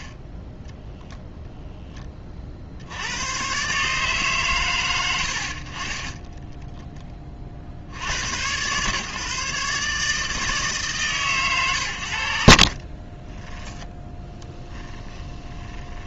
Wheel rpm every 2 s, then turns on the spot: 0, 80, 100, 10, 140, 150, 80, 10.
12-16